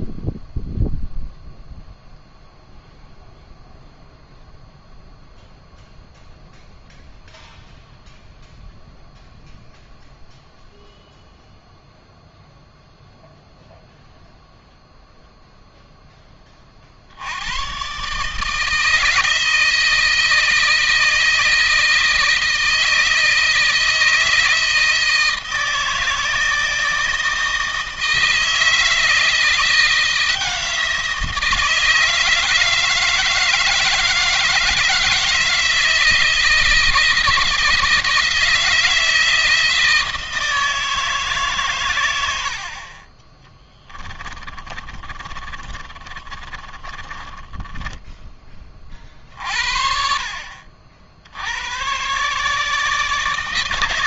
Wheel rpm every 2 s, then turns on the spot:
0, 0, 0, 0, 0, 0, 0, 0, 40, 160, 160, 160, 160, 160, 160, 170, 160, 160, 160, 160, 160, 50, 30, 30, 40, 70, 150.
44-48